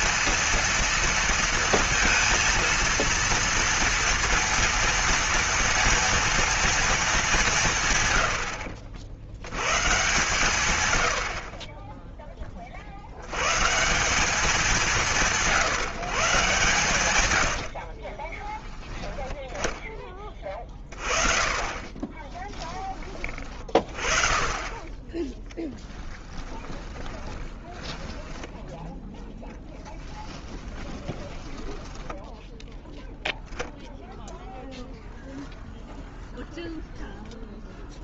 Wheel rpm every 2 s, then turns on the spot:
230, 230, 230, 230, 80, 130, 40, 190, 130, 30, 30, 20, 20, 20, 10, 20, 10, 0, 0.
26-28 30-32